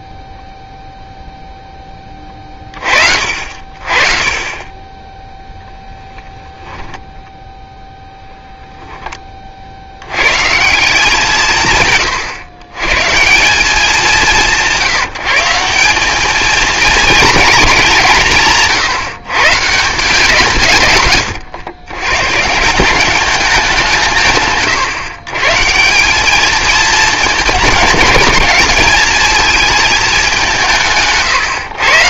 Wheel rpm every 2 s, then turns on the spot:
0, 30, 30, 10, 0, 140, 110, 180, 220, 140, 150, 160, 130, 220, 210, 160.
6-8